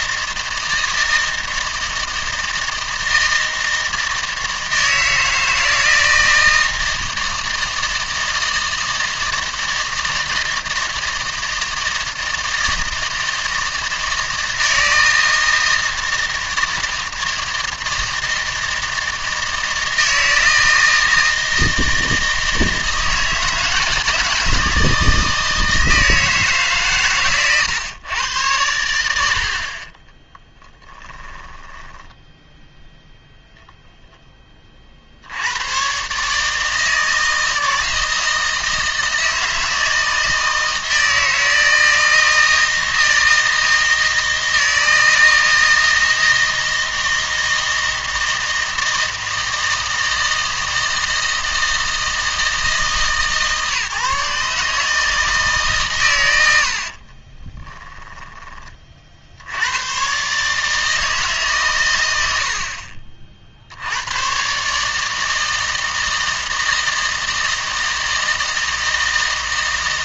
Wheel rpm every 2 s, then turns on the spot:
160, 160, 160, 160, 160, 160, 160, 160, 160, 160, 160, 160, 160, 140, 100, 20, 0, 30, 160, 160, 160, 160, 160, 160, 160, 160, 160, 150, 80, 30, 150, 60, 140, 160, 160.
30-32